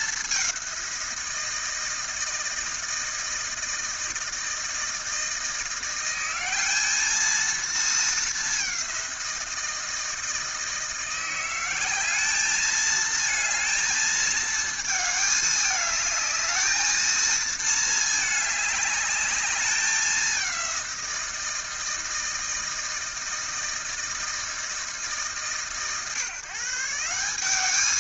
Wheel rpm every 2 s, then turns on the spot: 180, 160, 160, 210, 190, 170, 220, 220, 220, 210, 180, 160, 160, 160.
none